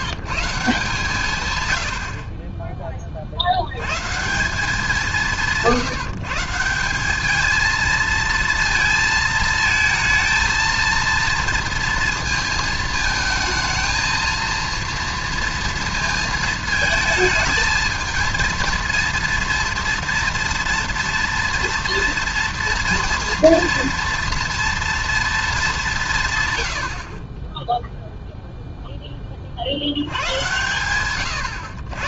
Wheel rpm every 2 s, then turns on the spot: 100, 100, 160, 220, 220, 230, 220, 230, 220, 230, 230, 230, 220, 20, 20, 120.
none